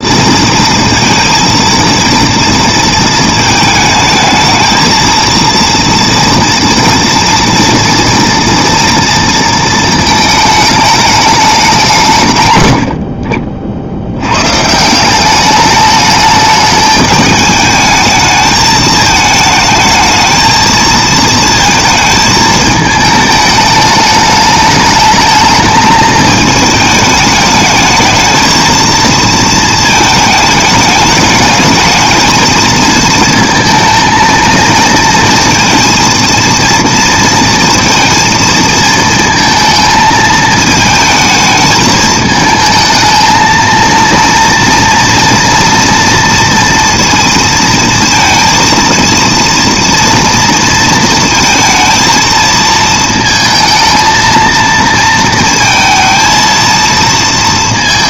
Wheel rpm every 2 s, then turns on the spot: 230, 230, 230, 230, 230, 220, 70, 170, 210, 220, 230, 220, 210, 210, 230, 210, 220, 230, 230, 230, 220, 220, 230, 230, 230, 230, 220, 230, 230.
none